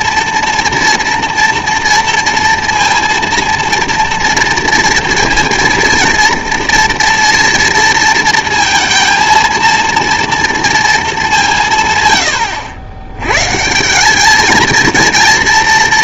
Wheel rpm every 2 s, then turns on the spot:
240, 230, 230, 230, 230, 230, 90, 220.
none